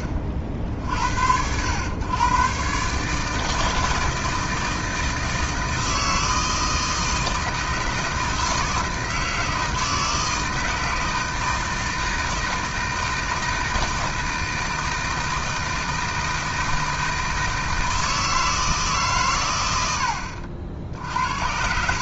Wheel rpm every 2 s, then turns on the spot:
50, 130, 160, 160, 160, 160, 160, 160, 160, 160, 60.
none